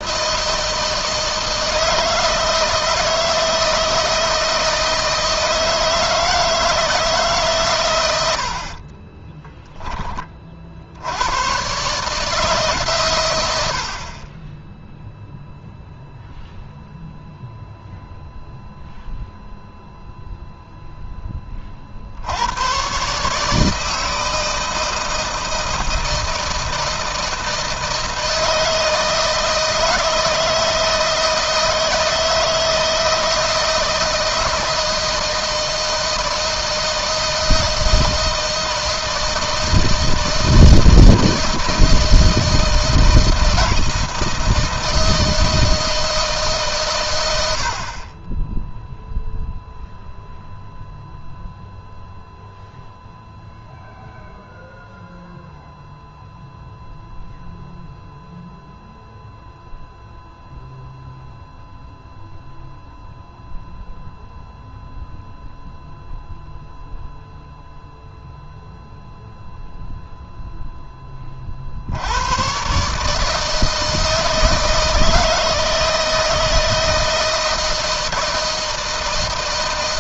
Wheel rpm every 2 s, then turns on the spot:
160, 160, 160, 150, 30, 80, 120, 0, 0, 0, 10, 140, 160, 160, 160, 160, 160, 160, 160, 160, 160, 160, 160, 110, 0, 0, 0, 0, 0, 0, 0, 0, 0, 0, 0, 20, 150, 160, 160, 160.
8-10